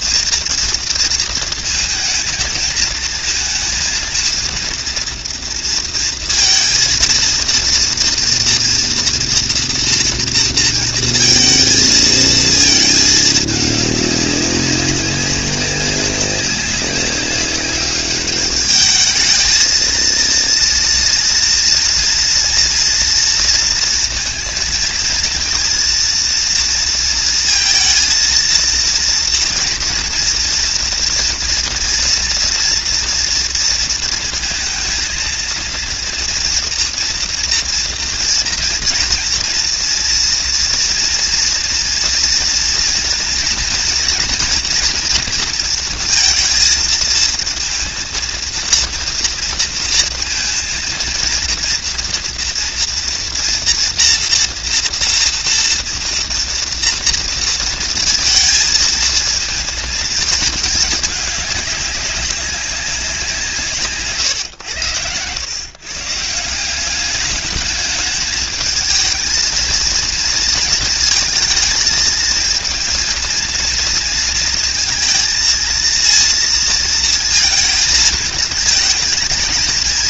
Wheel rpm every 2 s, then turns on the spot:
230, 220, 230, 230, 230, 230, 220, 200, 200, 200, 230, 230, 230, 230, 230, 230, 240, 230, 230, 240, 230, 230, 230, 230, 230, 230, 230, 230, 230, 230, 220, 190, 130, 140, 210, 220, 220, 230, 230, 220.
none